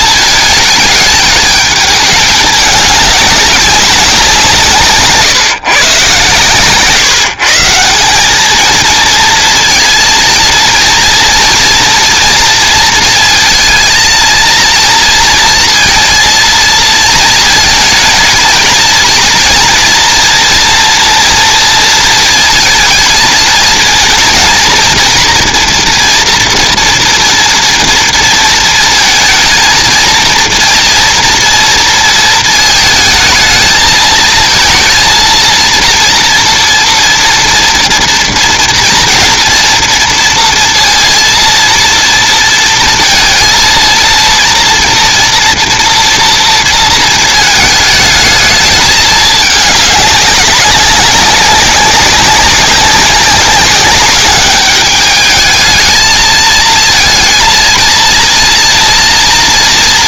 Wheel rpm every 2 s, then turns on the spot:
220, 200, 160, 140, 220, 230, 230, 230, 230, 220, 230, 220, 230, 230, 230, 230, 220, 230, 230, 230, 230, 230, 240, 230, 220, 190, 190, 200, 230, 230.
none